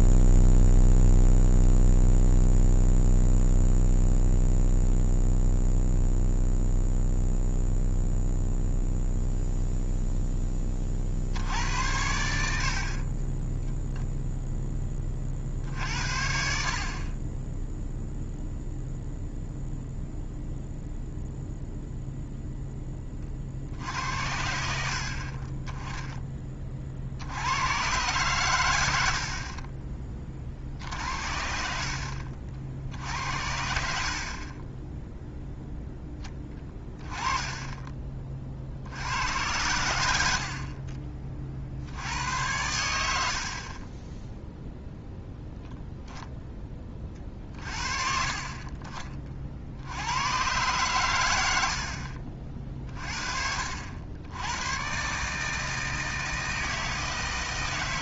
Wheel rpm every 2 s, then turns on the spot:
0, 0, 0, 0, 0, 20, 60, 0, 50, 0, 0, 10, 70, 30, 90, 50, 60, 20, 20, 60, 50, 110, 0, 20, 40, 120, 40, 100, 160.
30-32 36-38 40-42